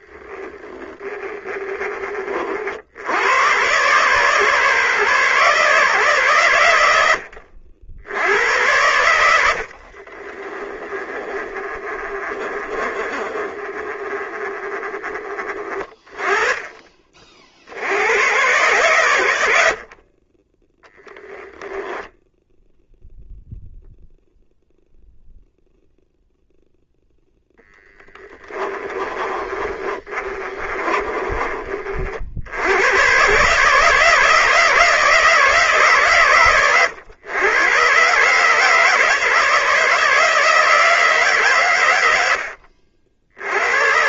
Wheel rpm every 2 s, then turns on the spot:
10, 70, 140, 90, 80, 20, 30, 20, 40, 100, 10, 0, 0, 0, 20, 30, 120, 160, 100, 160, 160, 80.
10-14 28-32